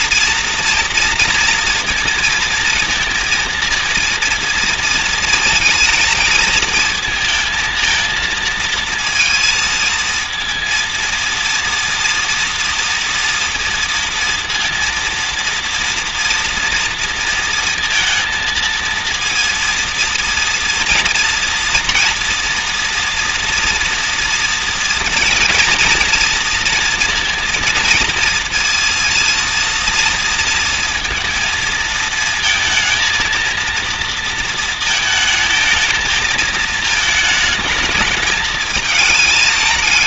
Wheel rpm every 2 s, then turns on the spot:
230, 230, 230, 220, 220, 230, 230, 230, 230, 230, 230, 230, 230, 230, 230, 230, 230, 230, 220, 220.
none